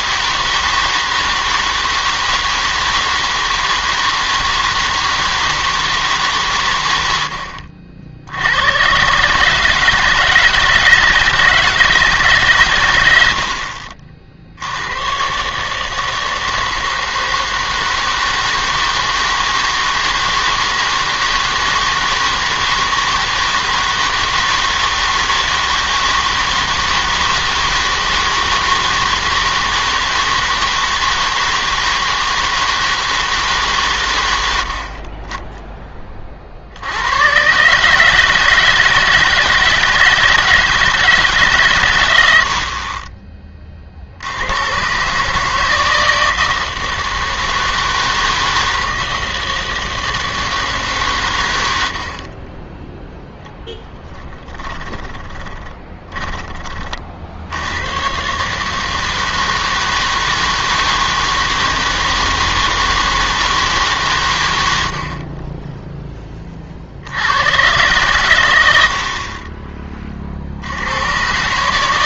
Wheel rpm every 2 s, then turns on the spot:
160, 160, 160, 120, 100, 160, 130, 70, 160, 160, 160, 160, 160, 160, 160, 160, 160, 70, 60, 160, 160, 70, 100, 160, 160, 160, 20, 20, 30, 150, 160, 160, 110, 30, 90, 70.
54-56